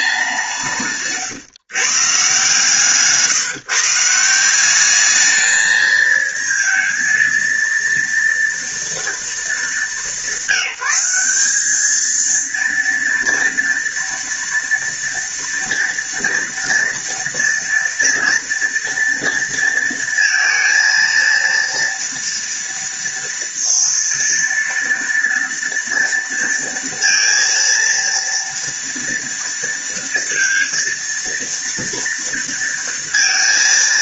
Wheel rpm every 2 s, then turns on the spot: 160, 150, 210, 230, 230, 190, 230, 230, 230, 230, 230, 230, 230, 230, 230, 230, 230.
none